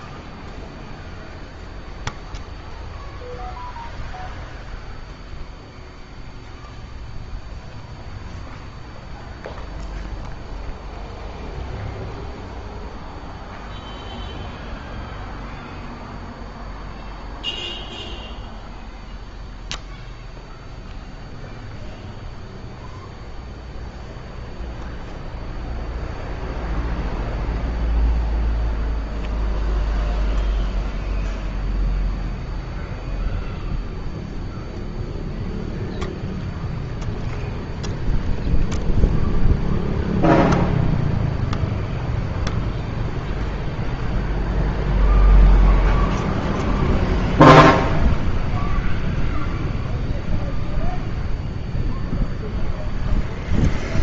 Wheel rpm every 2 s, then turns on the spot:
0, 0, 0, 0, 0, 0, 0, 0, 0, 0, 0, 0, 0, 0, 0, 0, 0, 0, 0, 0, 0, 0, 0, 0, 0, 0, 0.
none